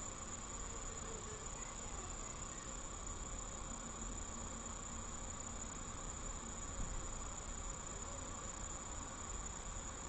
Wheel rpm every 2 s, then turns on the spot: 0, 0, 0, 0, 0.
none